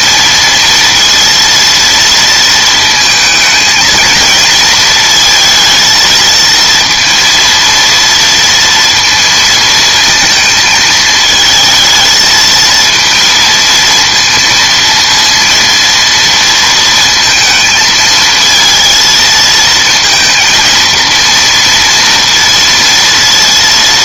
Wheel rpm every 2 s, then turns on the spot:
230, 230, 230, 230, 230, 220, 230, 230, 230, 230, 230, 230.
none